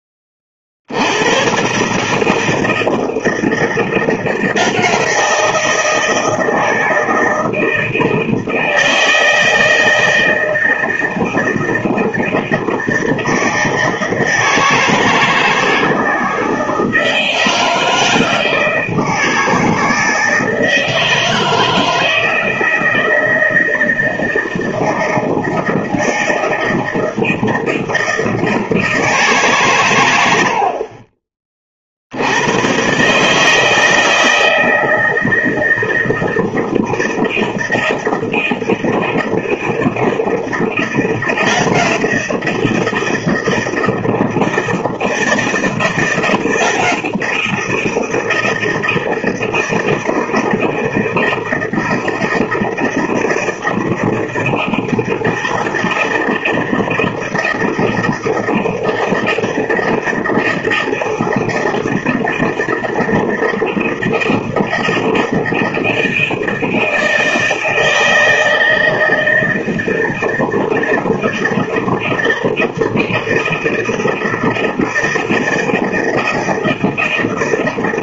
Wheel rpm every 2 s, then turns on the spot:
70, 160, 170, 160, 160, 160, 160, 160, 160, 160, 160, 160, 160, 160, 160, 40, 130, 160, 160, 160, 170, 170, 160, 170, 160, 160, 160, 160, 160, 160, 160, 160, 160, 160, 160, 160, 160, 160, 160.
none